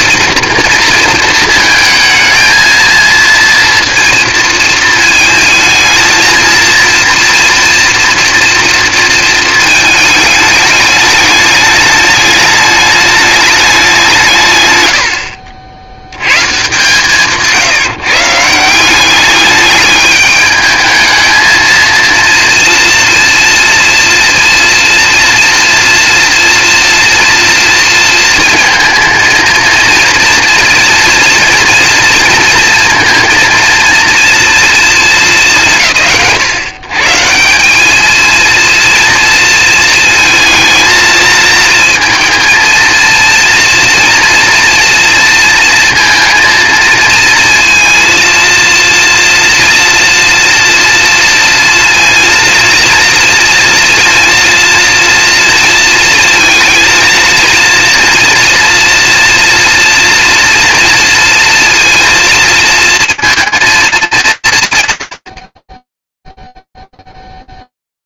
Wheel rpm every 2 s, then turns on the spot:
230, 220, 230, 230, 230, 210, 210, 130, 140, 180, 220, 230, 230, 230, 230, 230, 230, 230, 100, 230, 220, 230, 230, 230, 230, 230, 230, 230, 230, 230, 240, 230, 190, 0.
none